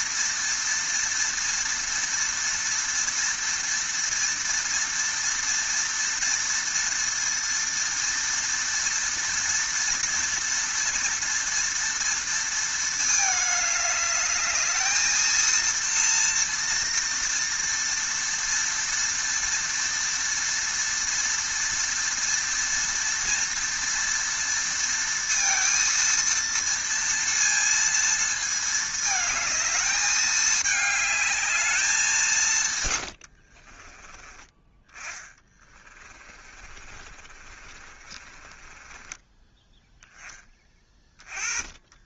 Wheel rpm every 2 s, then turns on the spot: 230, 240, 230, 230, 230, 230, 220, 220, 230, 230, 230, 230, 230, 230, 220, 210, 120, 20, 30, 20, 20.
32-40